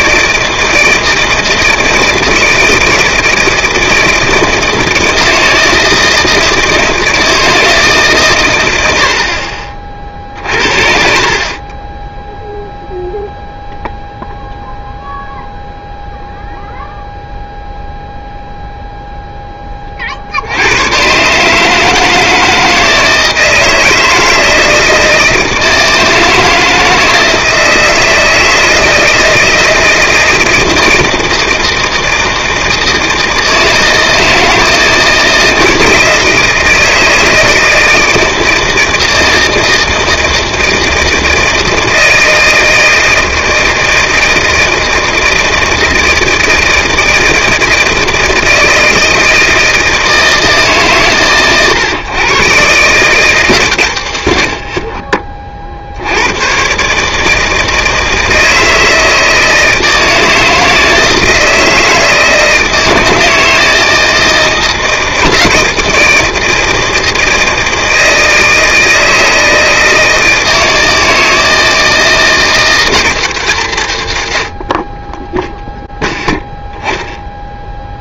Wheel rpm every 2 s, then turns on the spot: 160, 160, 160, 160, 80, 50, 0, 0, 0, 0, 110, 160, 160, 160, 160, 170, 160, 160, 160, 160, 160, 160, 160, 160, 160, 140, 140, 50, 140, 160, 160, 160, 160, 160, 160, 160, 180, 40, 0.
none